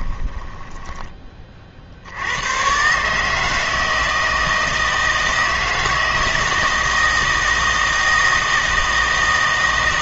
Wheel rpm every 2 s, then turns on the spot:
10, 120, 160, 160, 160.
0-2